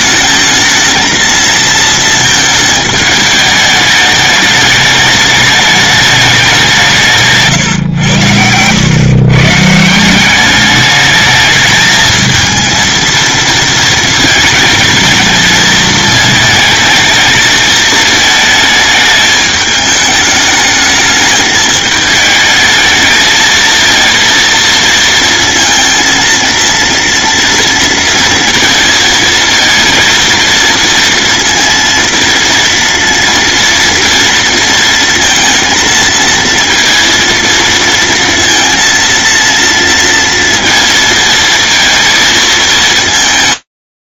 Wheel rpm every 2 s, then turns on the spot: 220, 220, 210, 180, 110, 200, 220, 220, 220, 220, 210, 220, 230, 230, 230, 230, 230, 230, 230, 230, 230, 220.
none